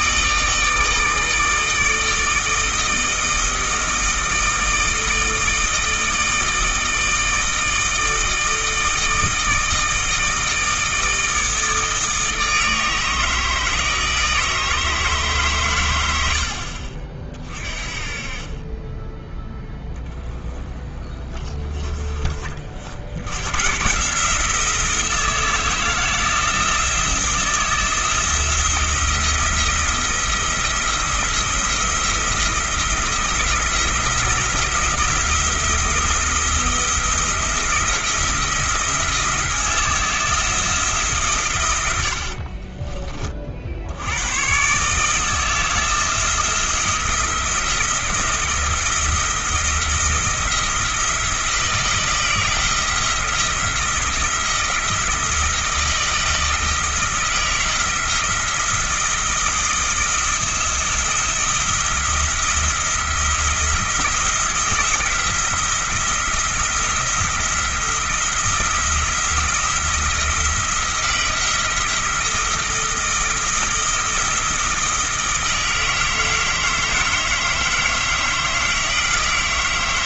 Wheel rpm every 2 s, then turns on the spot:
160, 160, 160, 160, 160, 160, 160, 150, 40, 20, 20, 60, 170, 160, 170, 170, 170, 170, 170, 170, 160, 40, 140, 170, 170, 160, 170, 170, 160, 170, 170, 170, 170, 170, 170, 170, 170, 160, 160, 160.
42-44